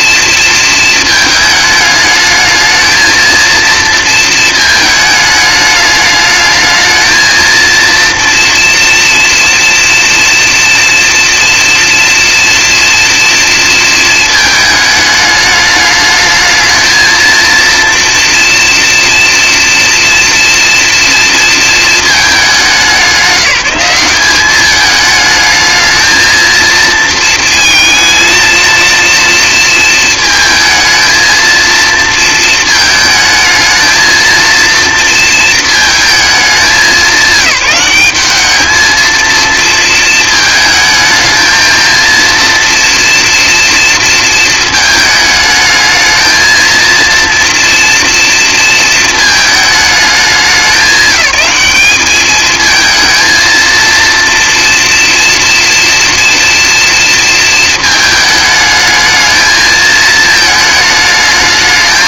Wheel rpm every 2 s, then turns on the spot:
230, 220, 220, 220, 230, 240, 240, 220, 220, 240, 230, 200, 200, 220, 230, 220, 220, 230, 190, 220, 220, 230, 220, 220, 230, 190, 220, 230, 240, 220, 210.
none